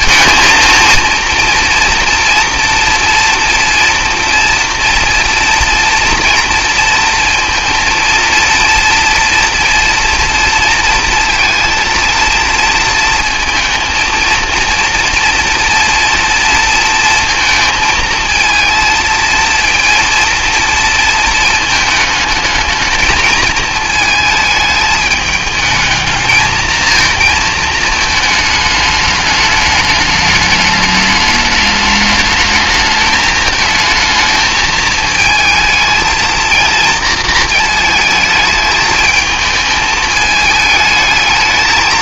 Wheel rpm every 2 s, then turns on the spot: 230, 230, 230, 230, 230, 230, 230, 230, 230, 220, 230, 220, 210, 220, 210, 210, 220, 220, 230, 220, 210.
none